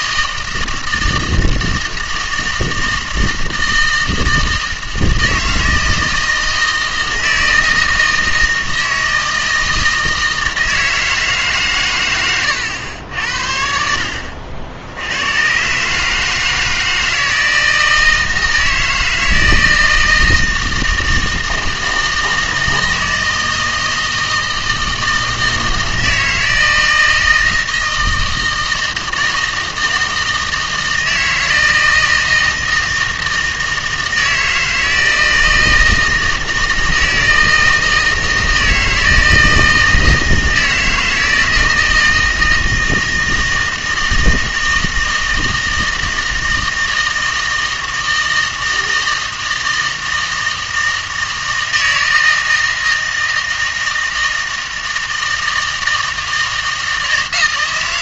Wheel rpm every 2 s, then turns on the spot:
160, 160, 160, 160, 160, 160, 90, 80, 160, 160, 160, 160, 160, 160, 160, 160, 160, 160, 160, 160, 160, 160, 160, 160, 160, 160, 160, 160, 160.
none